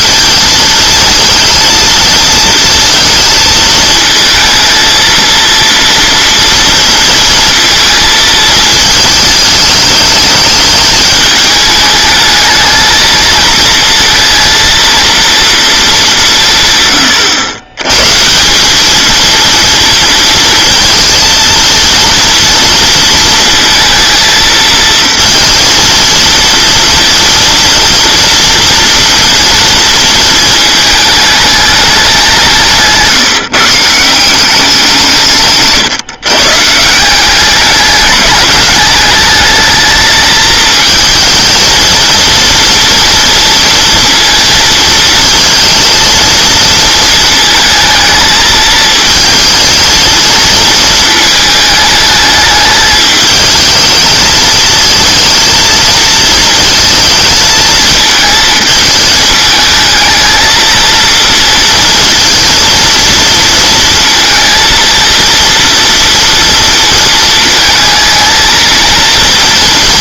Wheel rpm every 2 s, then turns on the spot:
230, 230, 230, 230, 220, 210, 210, 230, 140, 180, 230, 230, 230, 230, 230, 220, 160, 180, 150, 210, 220, 230, 230, 230, 220, 230, 210, 220, 220, 220, 220, 230, 230, 230, 230.
none